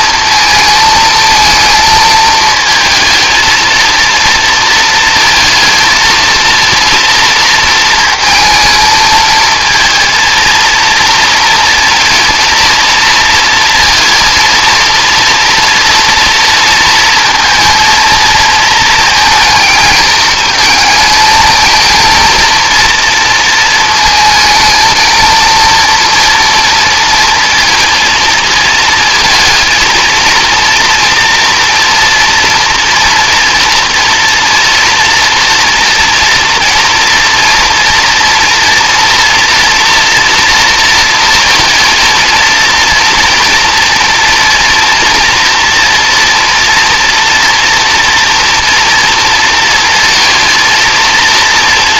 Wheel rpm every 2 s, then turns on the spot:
220, 220, 230, 230, 220, 230, 230, 230, 230, 230, 220, 230, 230, 230, 220, 230, 230, 230, 230, 230, 230, 230, 230, 230, 230, 230.
none